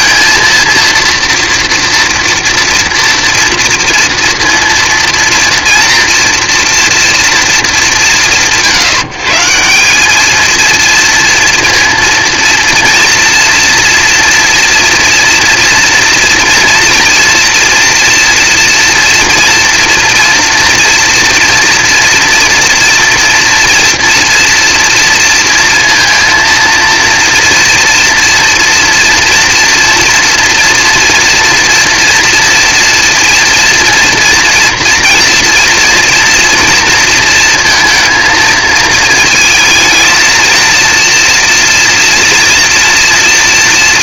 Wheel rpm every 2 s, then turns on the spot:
230, 230, 230, 230, 130, 230, 240, 240, 240, 240, 240, 230, 230, 230, 230, 230, 230, 230, 230, 220, 230, 240.
none